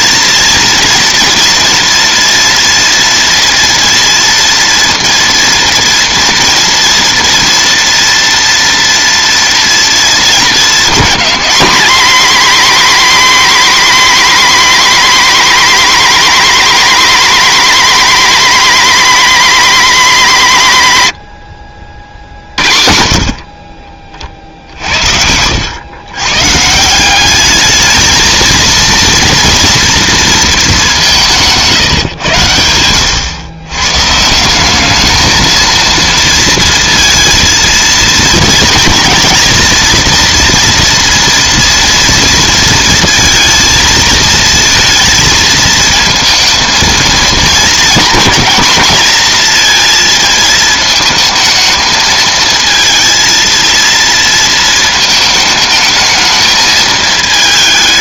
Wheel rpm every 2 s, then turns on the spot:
230, 230, 230, 230, 230, 220, 260, 250, 230, 240, 170, 60, 60, 150, 230, 210, 100, 190, 230, 230, 230, 230, 230, 230, 220, 220, 220, 220, 220.
none